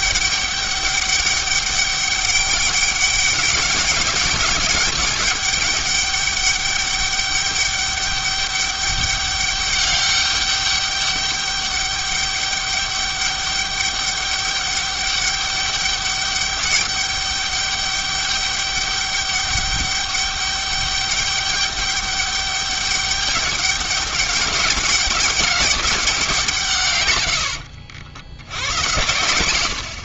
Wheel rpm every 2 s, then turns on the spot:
200, 200, 200, 200, 200, 200, 200, 200, 200, 200, 200, 200, 210, 140, 100.
none